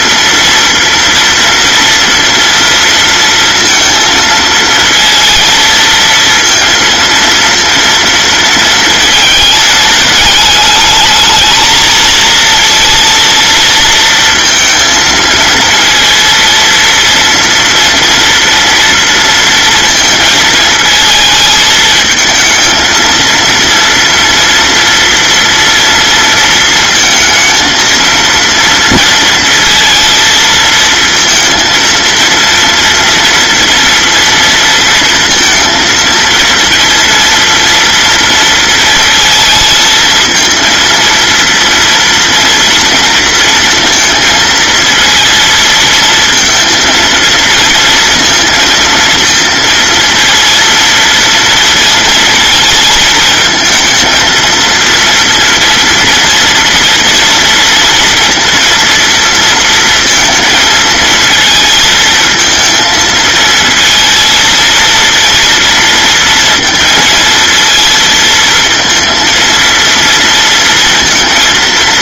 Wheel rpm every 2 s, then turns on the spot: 230, 230, 230, 230, 220, 210, 230, 230, 230, 230, 220, 230, 240, 230, 230, 230, 230, 230, 230, 230, 230, 240, 230, 230, 230, 230, 220, 230, 230, 230, 230, 220, 230, 230, 230, 230.
none